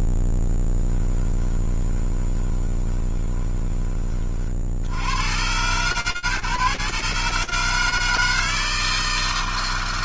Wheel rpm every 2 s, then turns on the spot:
10, 20, 80, 140, 160.
0-4